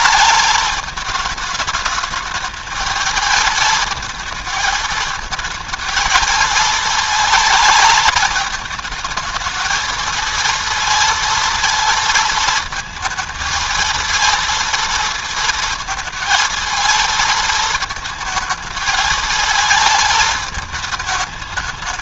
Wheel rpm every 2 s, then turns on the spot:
220, 220, 220, 220, 210, 230, 220, 230, 220, 220, 210.
none